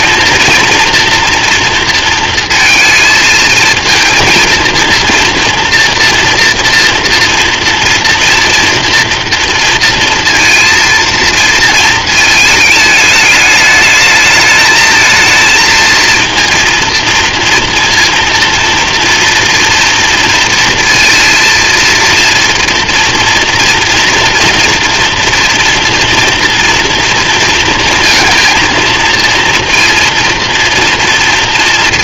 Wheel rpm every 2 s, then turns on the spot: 230, 220, 230, 230, 230, 230, 210, 220, 230, 230, 230, 240, 230, 230, 230, 240.
none